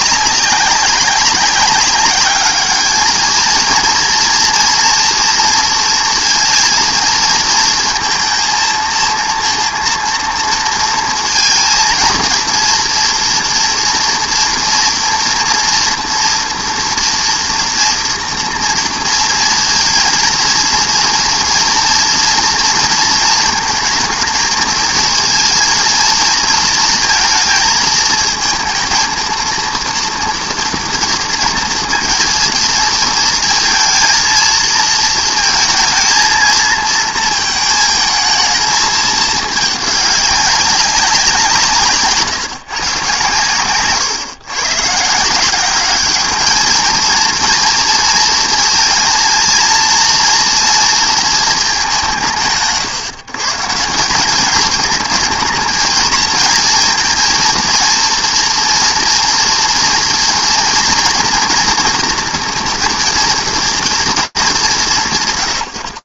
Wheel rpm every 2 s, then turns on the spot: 200, 200, 220, 230, 230, 230, 230, 230, 240, 230, 230, 230, 230, 230, 220, 230, 230, 230, 230, 220, 210, 170, 130, 180, 230, 230, 180, 160, 220, 230, 230, 230, 230.
none